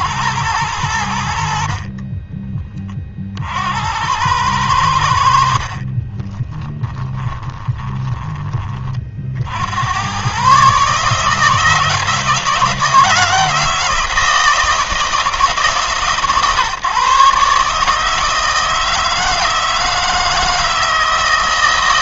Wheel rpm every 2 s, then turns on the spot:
100, 20, 90, 20, 30, 140, 160, 160, 130, 160, 160.
6-8